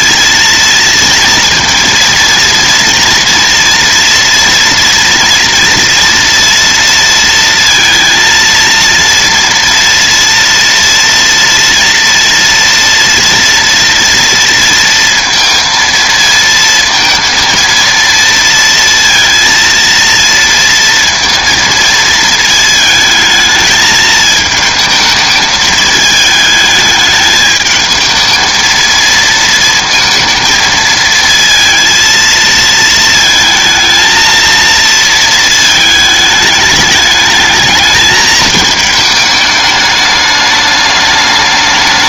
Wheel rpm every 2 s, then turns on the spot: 230, 230, 230, 230, 230, 230, 230, 230, 230, 230, 230, 220, 220, 220, 220, 230, 230, 230, 210, 220, 210.
none